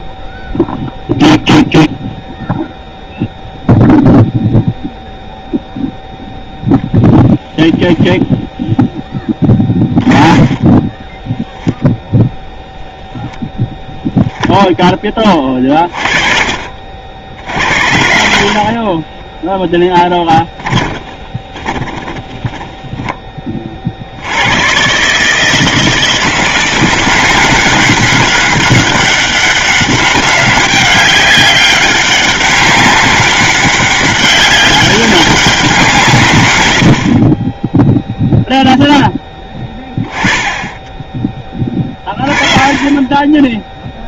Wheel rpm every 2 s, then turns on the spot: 0, 0, 0, 0, 0, 20, 0, 10, 60, 30, 10, 10, 120, 170, 200, 200, 200, 200, 90, 0, 10, 30.
10-12 20-22